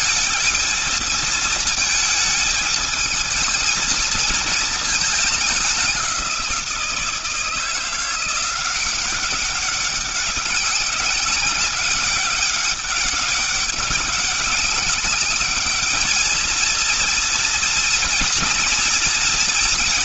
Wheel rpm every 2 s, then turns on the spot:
220, 220, 220, 170, 180, 190, 200, 200, 230, 230.
none